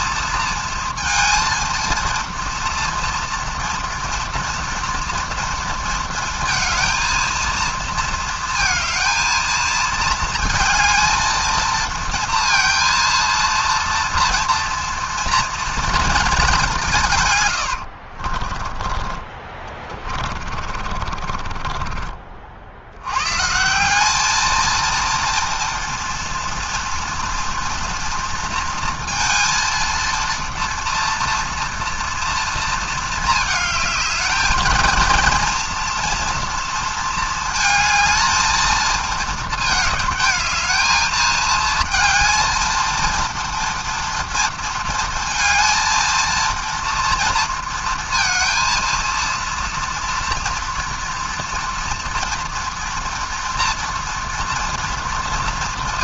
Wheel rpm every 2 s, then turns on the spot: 230, 230, 240, 230, 230, 220, 230, 230, 190, 40, 50, 70, 220, 240, 230, 230, 230, 220, 230, 220, 220, 230, 230, 230, 230, 230, 230, 230.
18-22